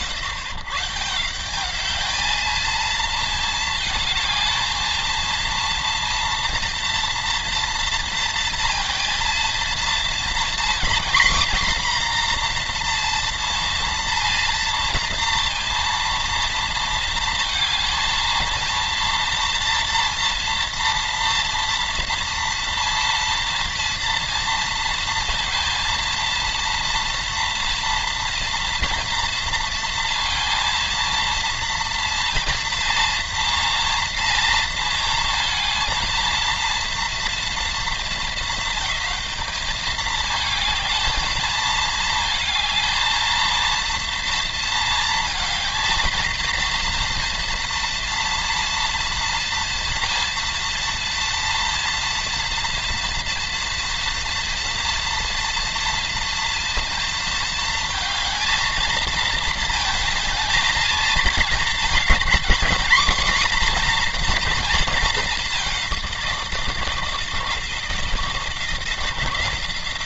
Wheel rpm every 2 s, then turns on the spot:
130, 230, 220, 230, 230, 240, 240, 230, 230, 230, 230, 230, 230, 230, 230, 230, 230, 230, 230, 200, 220, 220, 230, 230, 230, 230, 240, 230, 230, 220, 220, 240, 230, 170, 170.
none